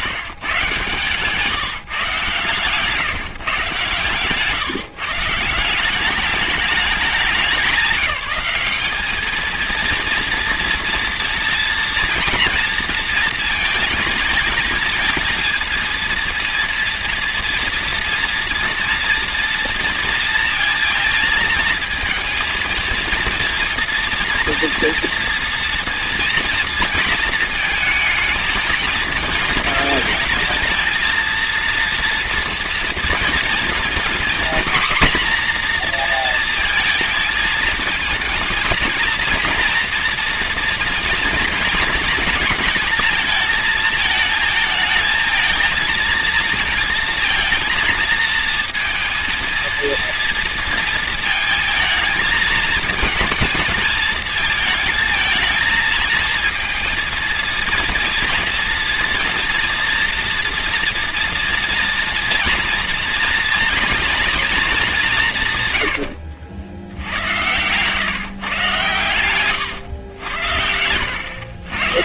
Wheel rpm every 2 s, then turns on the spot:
150, 130, 140, 210, 200, 230, 230, 220, 230, 230, 230, 230, 230, 230, 220, 230, 230, 230, 230, 220, 230, 220, 220, 230, 230, 230, 220, 220, 230, 230, 230, 230, 220, 80, 130, 90.
66-68 70-72